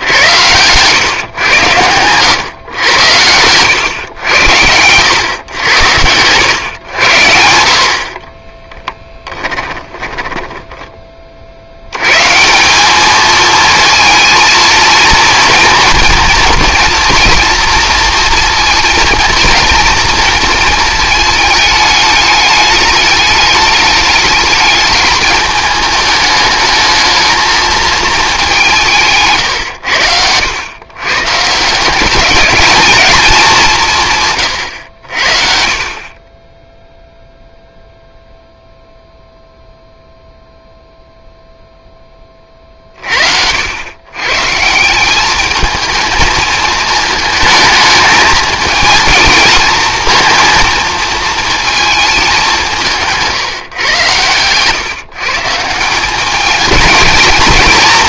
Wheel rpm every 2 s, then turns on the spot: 120, 100, 90, 110, 10, 20, 190, 220, 230, 230, 230, 210, 210, 220, 180, 110, 220, 90, 0, 0, 0, 40, 160, 220, 220, 230, 180, 130, 220.
8-10